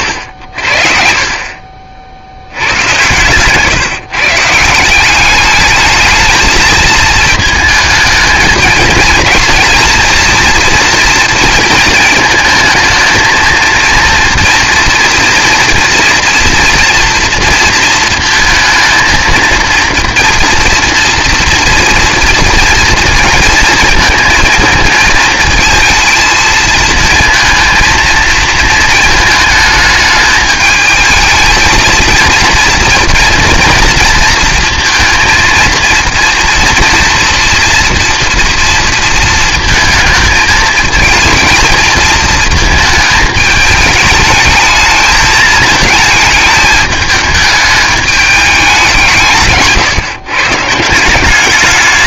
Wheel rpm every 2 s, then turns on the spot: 50, 100, 160, 220, 220, 230, 220, 240, 240, 230, 240, 230, 220, 230, 230, 220, 230, 230, 240, 230, 220, 220, 220, 210, 190, 160.
none